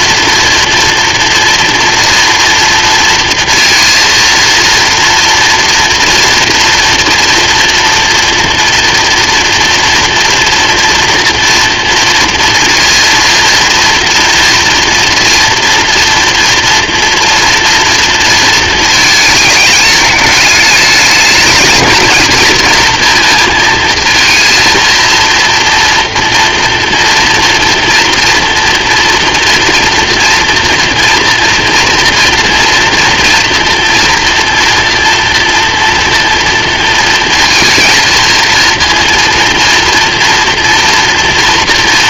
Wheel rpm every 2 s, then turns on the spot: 230, 230, 230, 240, 240, 230, 230, 230, 230, 230, 210, 220, 230, 230, 230, 230, 230, 230, 230, 230, 240.
none